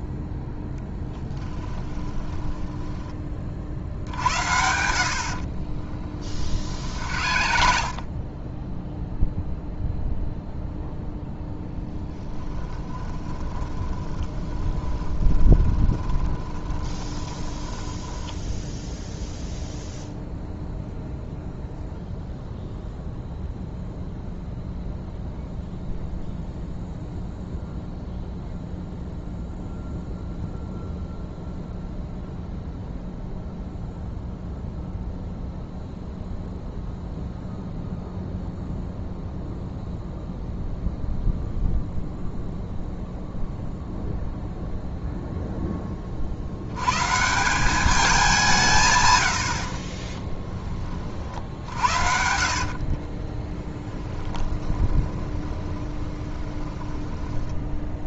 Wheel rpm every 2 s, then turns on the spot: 0, 10, 80, 50, 10, 0, 10, 20, 20, 0, 0, 0, 0, 0, 0, 0, 0, 0, 0, 0, 0, 0, 0, 100, 150, 20, 50, 20, 10.
2-4 6-8 12-18 52-58